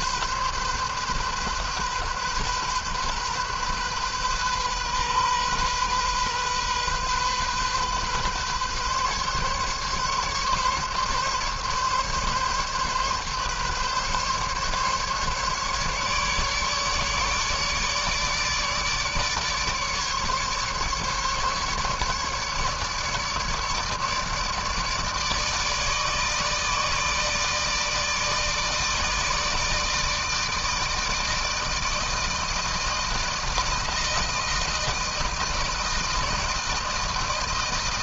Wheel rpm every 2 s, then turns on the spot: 130, 130, 130, 130, 140, 140, 140, 140, 150, 150, 140, 150, 150, 150, 160, 160, 160, 160, 160.
none